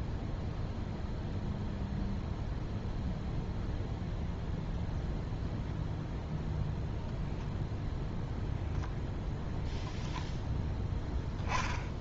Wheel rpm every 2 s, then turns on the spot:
0, 0, 0, 0, 0, 0.
none